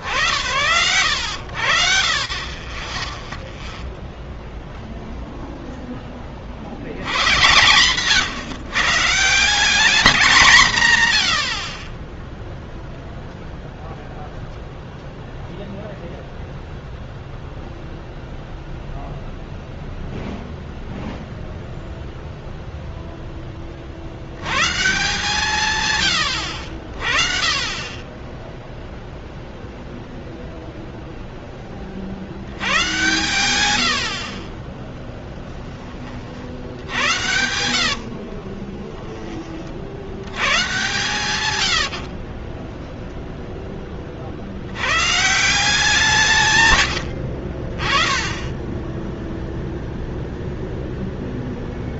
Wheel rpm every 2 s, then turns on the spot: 30, 0, 20, 140, 210, 30, 0, 0, 0, 0, 0, 10, 160, 40, 0, 10, 100, 20, 90, 40, 90, 10, 170, 60, 0, 0.
36-38 40-42